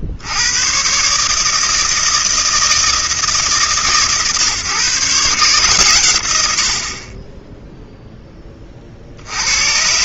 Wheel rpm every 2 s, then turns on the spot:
80, 160, 140, 110, 10.
none